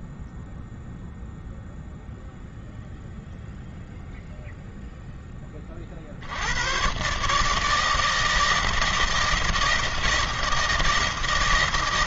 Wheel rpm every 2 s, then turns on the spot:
0, 0, 0, 110, 160, 160.
none